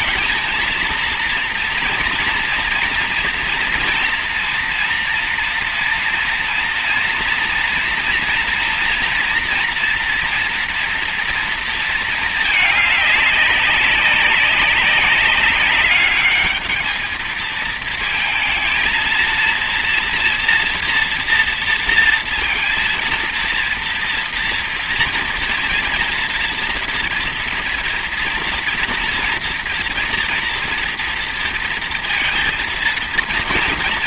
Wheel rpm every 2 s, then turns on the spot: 230, 240, 230, 230, 230, 230, 200, 200, 220, 230, 230, 230, 240, 230, 230, 230, 230.
none